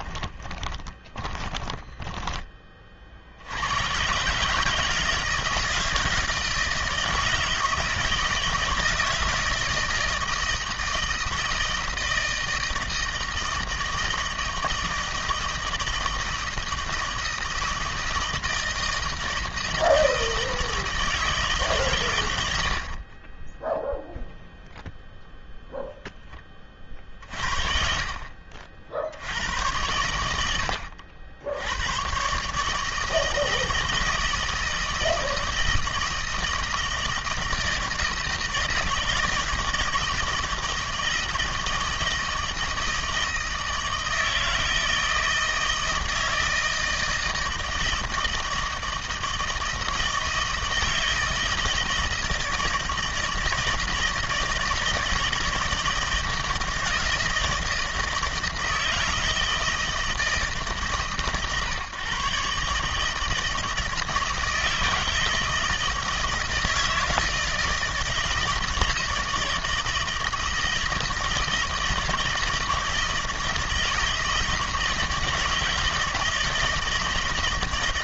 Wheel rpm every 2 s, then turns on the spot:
20, 30, 150, 170, 160, 160, 160, 160, 160, 160, 160, 70, 0, 30, 50, 90, 150, 160, 160, 160, 160, 160, 160, 160, 160, 160, 160, 160, 160, 160, 150, 140, 160, 160, 160, 160, 160, 160, 160.
0-2